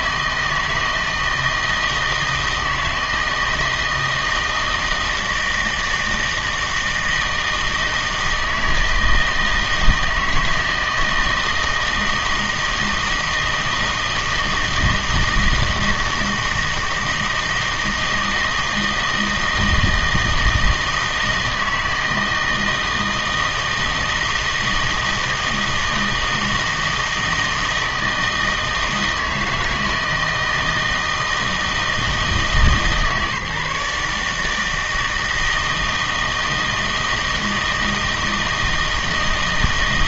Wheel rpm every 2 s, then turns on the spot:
160, 160, 160, 160, 160, 160, 160, 160, 160, 160, 160, 160, 160, 160, 160, 160, 150, 160, 160, 160.
none